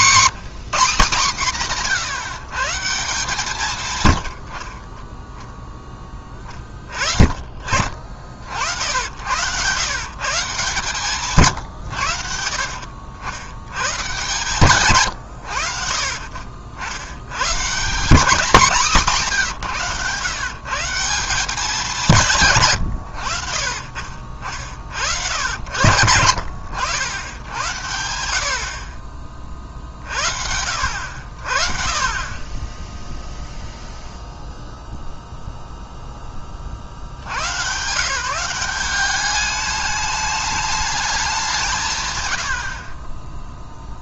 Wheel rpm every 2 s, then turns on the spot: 210, 140, 60, 20, 60, 150, 80, 130, 60, 210, 150, 130, 50, 80, 60, 70, 30, 0, 30, 180, 210, 80.
none